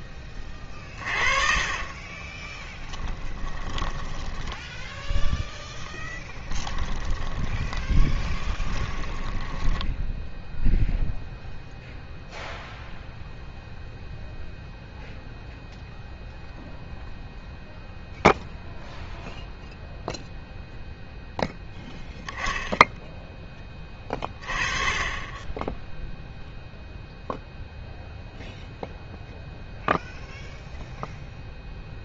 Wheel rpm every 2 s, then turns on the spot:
30, 20, 10, 10, 10, 0, 0, 0, 0, 0, 0, 10, 30, 0, 0, 0.
0-10